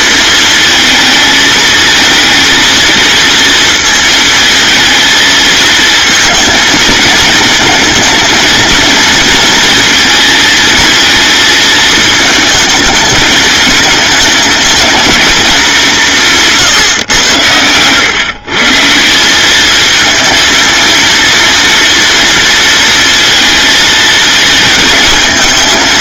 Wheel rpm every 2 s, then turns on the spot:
220, 230, 230, 220, 230, 220, 210, 230, 110, 190, 230, 220, 220.
none